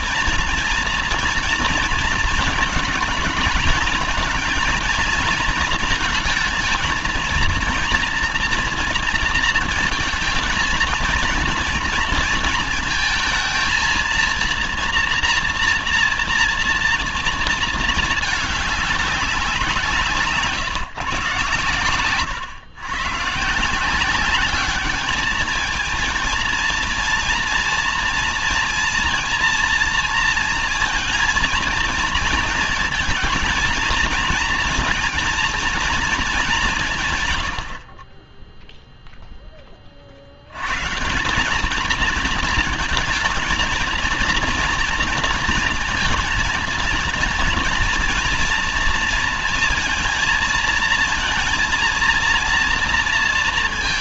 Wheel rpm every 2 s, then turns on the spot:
230, 230, 230, 230, 230, 220, 230, 230, 230, 200, 140, 120, 200, 230, 230, 230, 230, 230, 170, 0, 130, 230, 230, 220, 230, 230, 230.
none